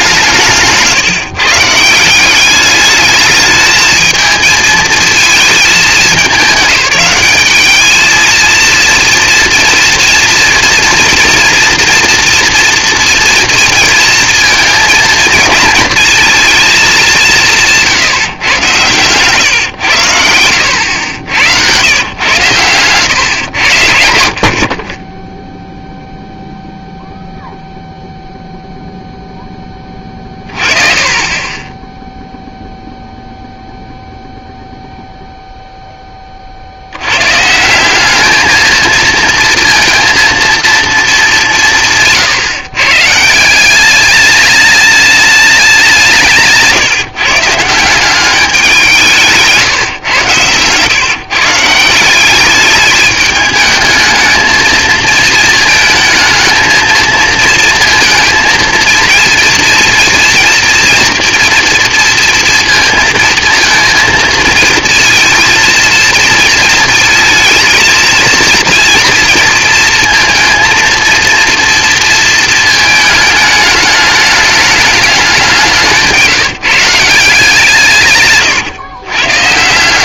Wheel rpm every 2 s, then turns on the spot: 160, 210, 220, 200, 230, 230, 230, 220, 210, 120, 80, 120, 30, 0, 0, 30, 0, 0, 90, 230, 220, 140, 210, 150, 180, 130, 210, 220, 220, 230, 230, 230, 230, 230, 230, 230, 220, 210, 160, 130.
none